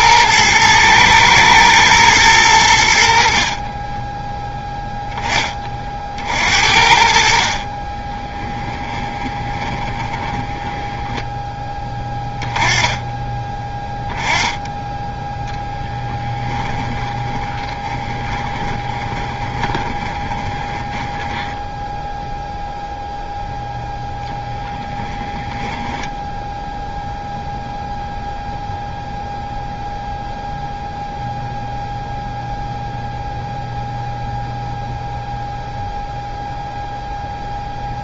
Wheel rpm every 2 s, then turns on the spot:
110, 90, 10, 60, 10, 10, 10, 10, 10, 20, 20, 0, 10, 0, 0, 0, 0, 0, 0.
8-12 16-22 24-26